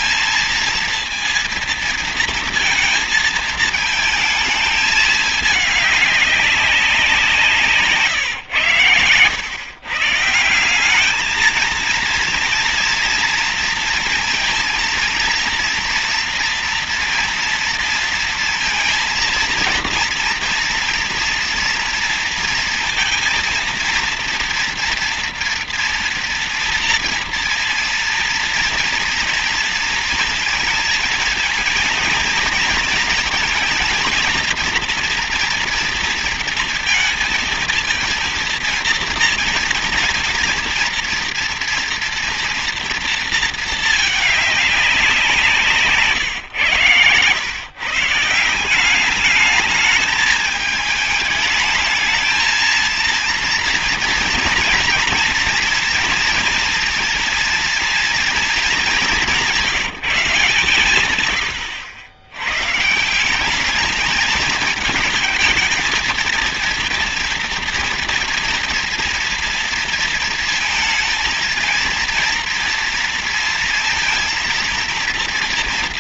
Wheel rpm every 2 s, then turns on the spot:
230, 230, 220, 190, 120, 180, 230, 230, 230, 230, 230, 230, 230, 230, 230, 230, 220, 230, 230, 230, 240, 230, 210, 150, 170, 220, 230, 230, 240, 220, 160, 130, 220, 230, 240, 230, 230, 230.
none